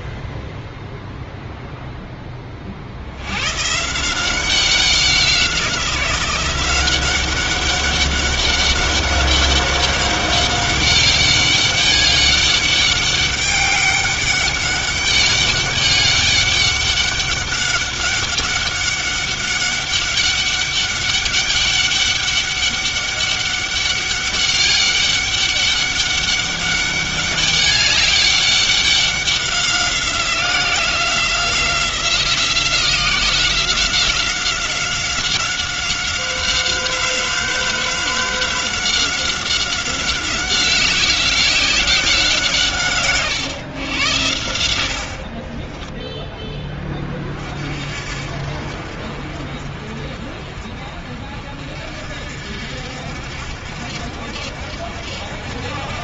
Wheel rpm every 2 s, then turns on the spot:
0, 30, 190, 180, 200, 200, 200, 200, 200, 200, 200, 200, 200, 200, 200, 180, 180, 180, 190, 190, 190, 160, 90, 10, 60, 40, 60, 60.
none